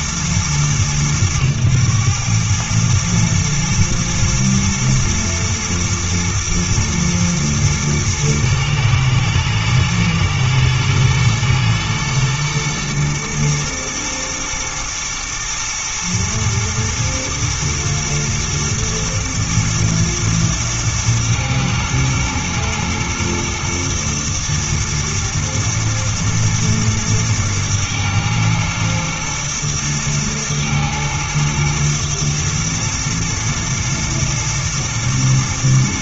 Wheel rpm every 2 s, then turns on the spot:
110, 110, 110, 110, 110, 110, 110, 120, 110, 120, 120, 110, 110, 120, 110, 110, 110, 110.
none